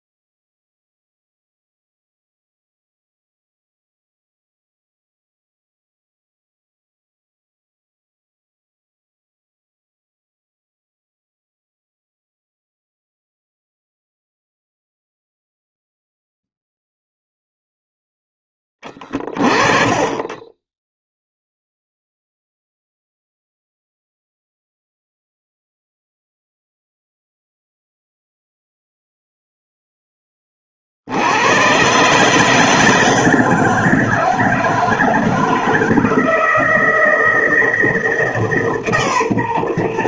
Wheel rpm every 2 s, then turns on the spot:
0, 0, 0, 0, 0, 0, 0, 0, 0, 20, 10, 0, 0, 0, 0, 50, 160, 160, 160, 150.
none